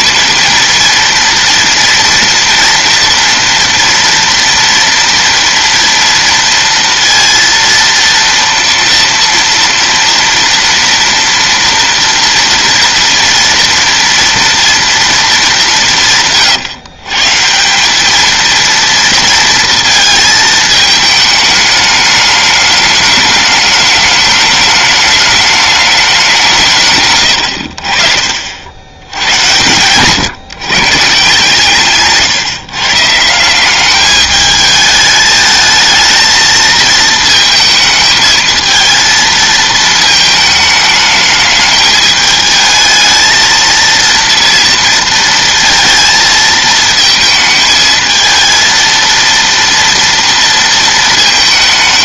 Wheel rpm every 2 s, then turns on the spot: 230, 230, 230, 230, 230, 240, 230, 230, 130, 230, 220, 210, 210, 170, 60, 120, 140, 210, 220, 220, 220, 220, 230, 220, 230, 230.
none